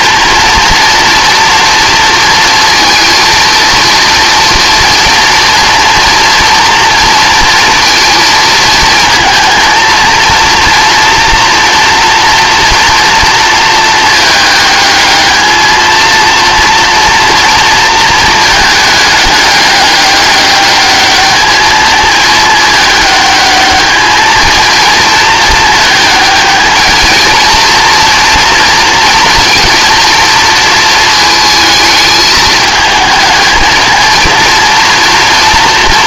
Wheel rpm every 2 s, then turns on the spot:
230, 230, 230, 230, 230, 230, 240, 220, 230, 220, 210, 210, 220, 220, 240, 230, 220, 230.
none